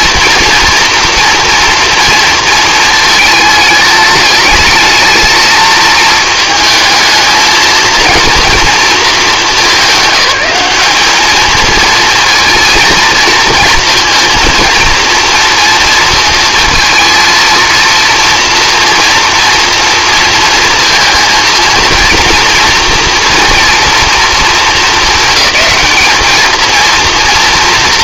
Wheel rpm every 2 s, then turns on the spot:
230, 230, 220, 220, 230, 210, 230, 230, 220, 230, 220, 230, 220, 230.
none